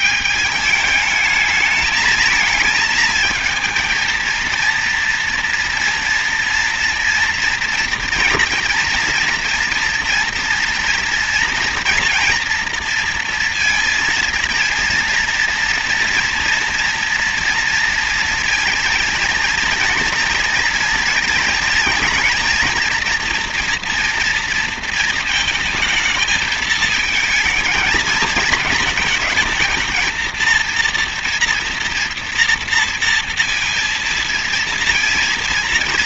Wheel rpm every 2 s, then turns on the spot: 220, 220, 230, 230, 230, 230, 230, 230, 230, 230, 230, 230, 230, 220, 220, 230, 230, 230.
none